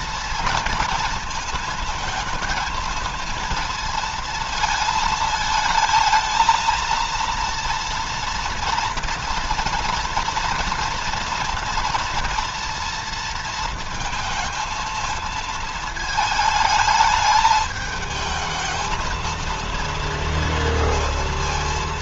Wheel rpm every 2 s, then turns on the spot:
230, 220, 220, 230, 230, 230, 230, 220, 220, 220, 230.
none